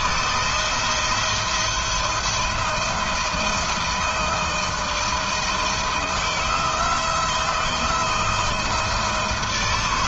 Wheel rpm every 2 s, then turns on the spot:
170, 160, 160, 170, 160.
none